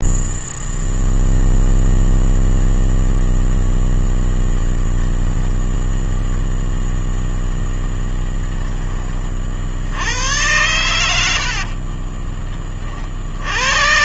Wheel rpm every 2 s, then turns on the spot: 0, 0, 0, 0, 20, 90, 40.
none